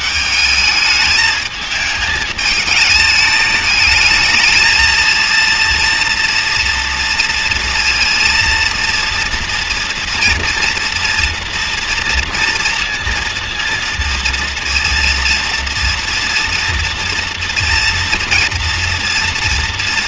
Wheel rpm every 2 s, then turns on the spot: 220, 210, 230, 230, 230, 230, 230, 230, 230, 240.
none